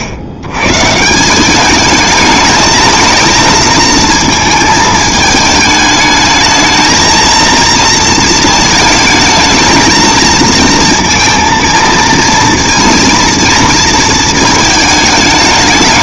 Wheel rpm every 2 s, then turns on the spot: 120, 220, 220, 220, 230, 230, 230, 220.
none